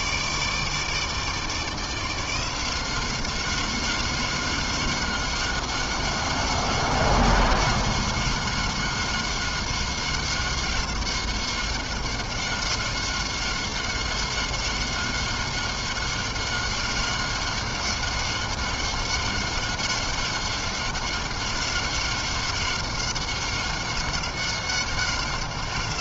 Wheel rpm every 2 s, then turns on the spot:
160, 190, 190, 190, 190, 190, 190, 190, 190, 190, 190, 190, 190.
none